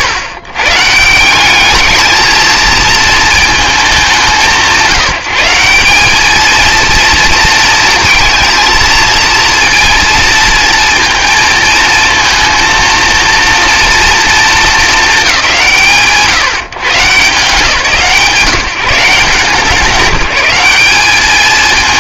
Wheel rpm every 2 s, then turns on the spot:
140, 220, 170, 220, 220, 230, 230, 230, 140, 170, 200.
none